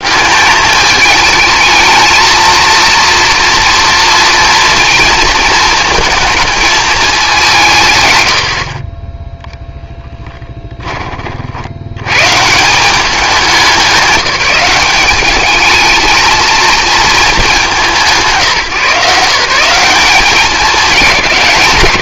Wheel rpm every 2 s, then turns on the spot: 210, 230, 230, 210, 30, 20, 180, 200, 220, 170, 200.
none